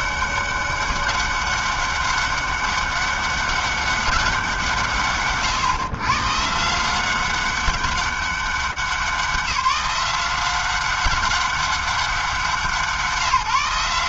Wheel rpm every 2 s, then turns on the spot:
190, 200, 200, 130, 190, 190, 190.
none